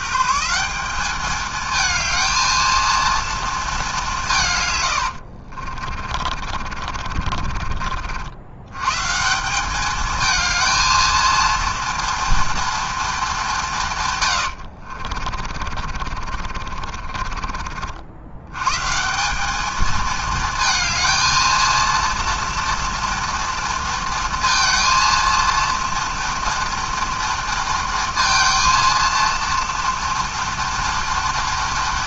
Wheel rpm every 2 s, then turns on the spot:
180, 230, 100, 50, 120, 220, 230, 50, 50, 140, 220, 230, 230, 230, 230, 240.
4-8 14-18